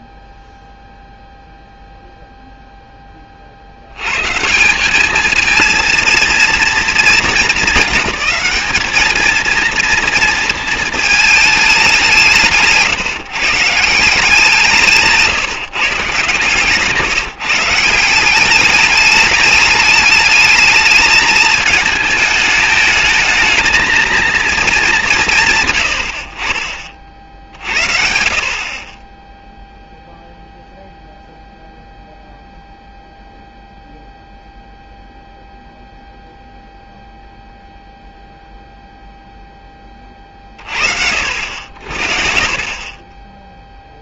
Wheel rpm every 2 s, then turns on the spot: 0, 0, 170, 220, 200, 230, 150, 180, 150, 200, 210, 220, 170, 40, 40, 0, 0, 0, 0, 0, 40, 40.
none